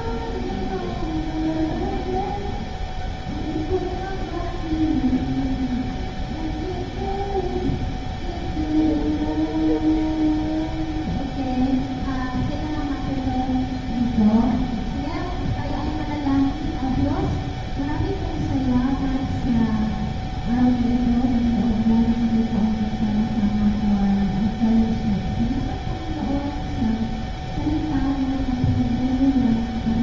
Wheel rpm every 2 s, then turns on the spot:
0, 0, 0, 0, 0, 0, 0, 0, 0, 0, 0, 0, 0, 0, 0.
none